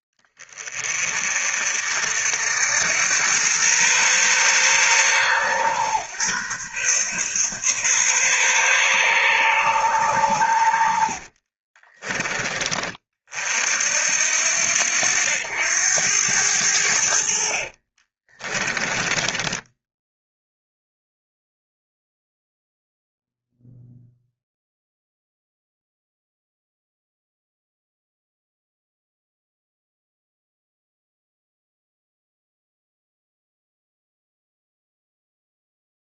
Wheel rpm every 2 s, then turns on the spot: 30, 80, 130, 130, 130, 80, 30, 80, 80, 20, 0, 0, 0, 0, 0, 0, 0, 0.
10-12